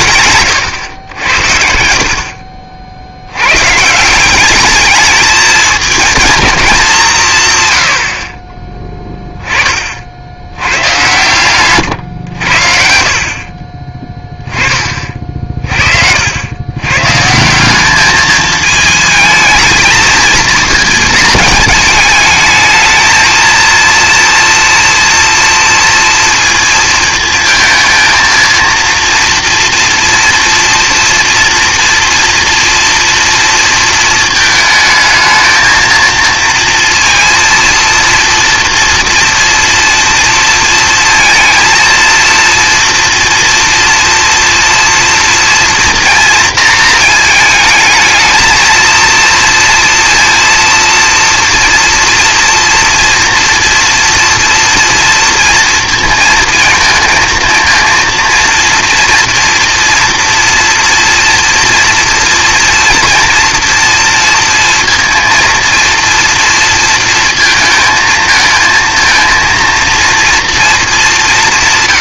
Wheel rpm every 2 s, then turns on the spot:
110, 50, 210, 210, 20, 100, 70, 30, 120, 220, 220, 220, 230, 220, 230, 230, 240, 220, 230, 230, 230, 230, 230, 230, 230, 230, 230, 230, 220, 230, 230, 230, 230, 230, 230, 210.
none